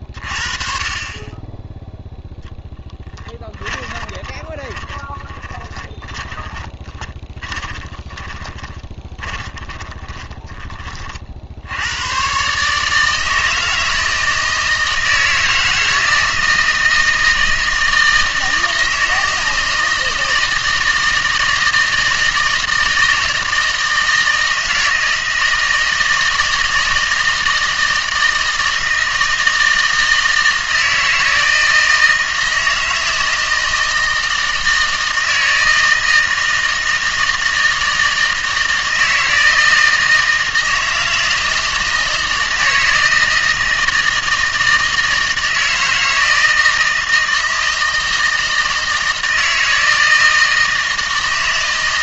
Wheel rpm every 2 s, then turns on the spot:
40, 0, 10, 20, 30, 30, 150, 160, 160, 160, 160, 160, 160, 160, 160, 160, 160, 160, 160, 160, 160, 160, 160, 160, 160, 160.
4-10